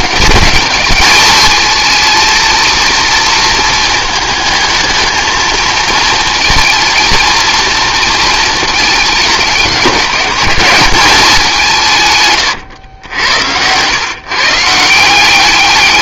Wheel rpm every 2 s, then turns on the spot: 200, 230, 220, 230, 220, 190, 120, 160.
12-14